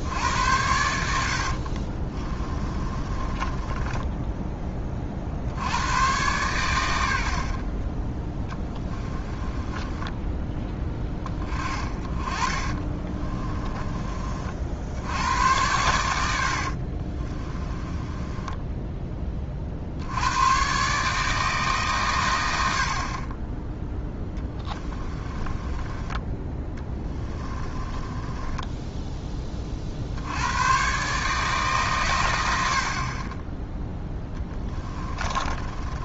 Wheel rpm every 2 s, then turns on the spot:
80, 30, 20, 100, 10, 10, 30, 60, 50, 10, 130, 70, 20, 20, 10, 110, 70, 20.
2-4 8-10 12-14 16-20 24-30 34-36